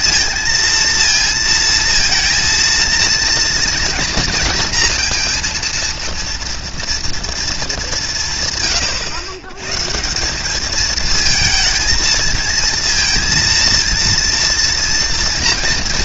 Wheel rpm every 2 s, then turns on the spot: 230, 230, 230, 230, 140, 200, 230, 230.
none